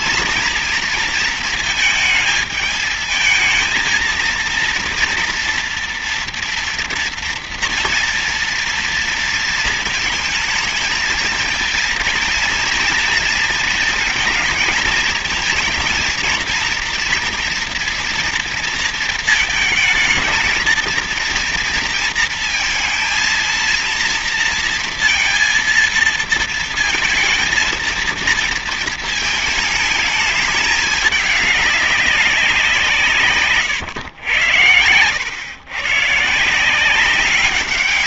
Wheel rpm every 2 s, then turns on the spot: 230, 220, 230, 230, 230, 220, 230, 220, 240, 230, 230, 230, 230, 230, 220, 210, 180, 90, 170.
34-36